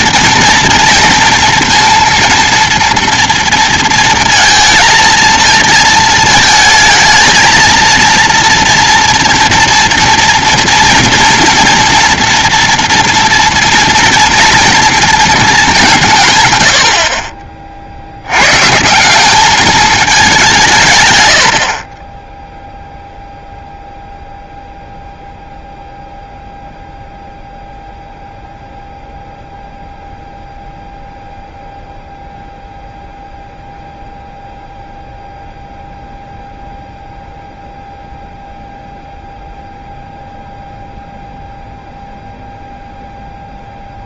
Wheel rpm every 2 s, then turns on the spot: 230, 230, 230, 220, 240, 230, 230, 240, 90, 140, 160, 0, 0, 0, 0, 0, 0, 0, 0, 0, 0, 0.
none